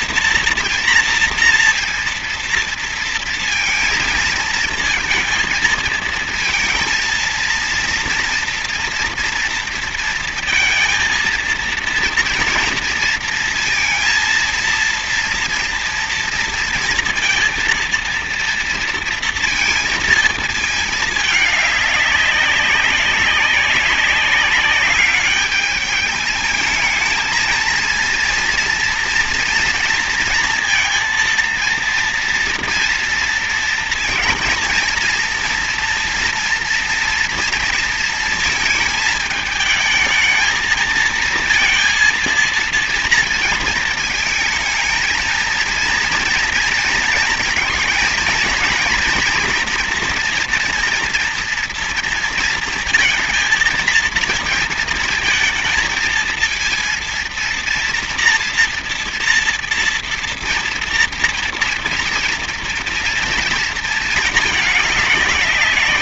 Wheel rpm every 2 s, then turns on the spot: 230, 230, 220, 230, 240, 230, 230, 230, 230, 230, 220, 200, 200, 210, 230, 230, 230, 230, 230, 220, 220, 230, 230, 240, 230, 230, 230, 230, 230, 230, 230, 230, 220.
none